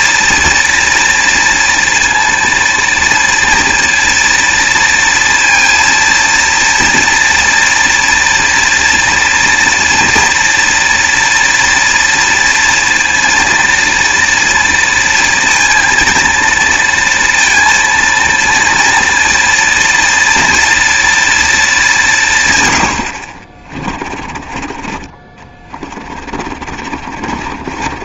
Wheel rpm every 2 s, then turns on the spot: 230, 230, 230, 230, 230, 230, 230, 230, 230, 230, 230, 100, 30, 50.
26-28